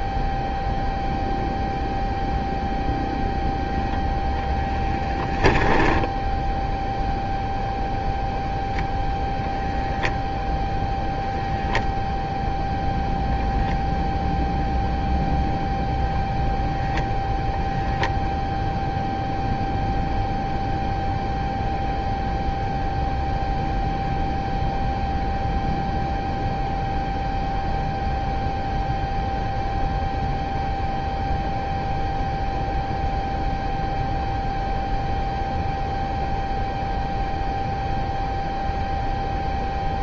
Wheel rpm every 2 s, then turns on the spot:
0, 0, 0, 0, 0, 0, 0, 0, 0, 0, 0, 0, 0, 0, 0, 0, 0, 0, 0, 0.
none